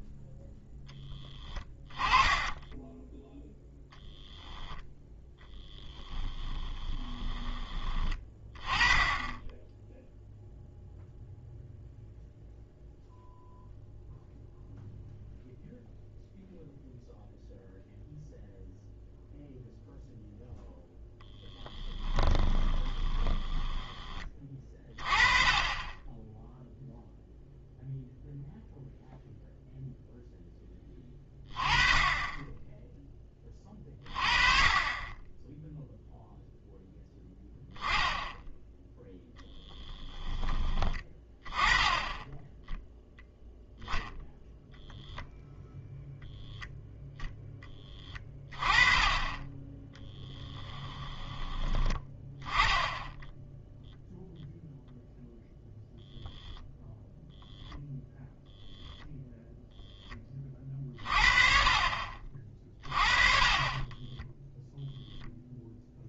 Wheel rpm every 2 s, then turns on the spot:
0, 10, 10, 20, 10, 0, 0, 0, 0, 0, 0, 20, 30, 0, 0, 10, 10, 30, 0, 0, 20, 10, 0, 0, 20, 10, 10, 0, 0, 0, 40, 30, 0.
2-4 6-8 22-24 62-64